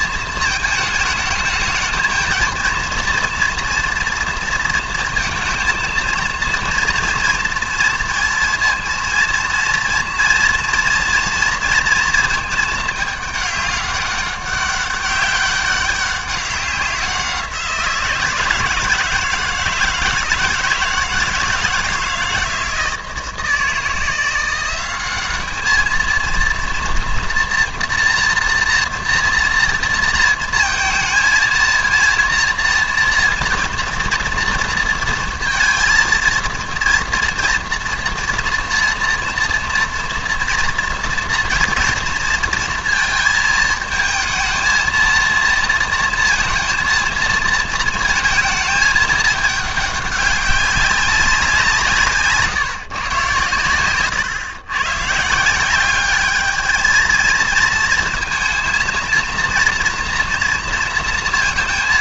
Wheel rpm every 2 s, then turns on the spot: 220, 230, 230, 230, 230, 230, 220, 200, 190, 160, 160, 160, 180, 230, 230, 220, 240, 230, 230, 240, 230, 220, 220, 230, 220, 200, 150, 120, 220, 230, 240.
none